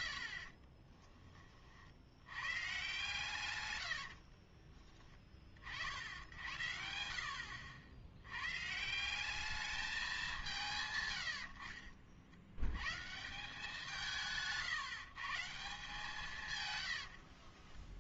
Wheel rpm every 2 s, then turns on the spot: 40, 140, 30, 60, 160, 120, 120, 160, 90.
0-2 4-6